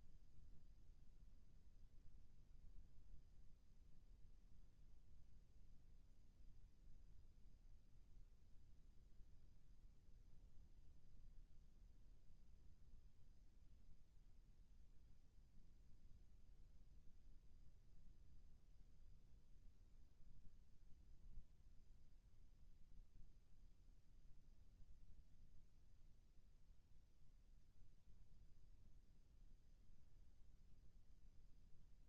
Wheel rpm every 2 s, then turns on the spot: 0, 0, 0, 0, 0, 0, 0, 0, 0, 0, 0, 0, 0, 0, 0, 0.
none